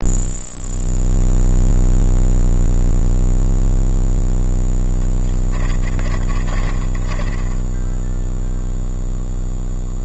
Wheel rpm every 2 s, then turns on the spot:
0, 0, 10, 20, 0.
4-8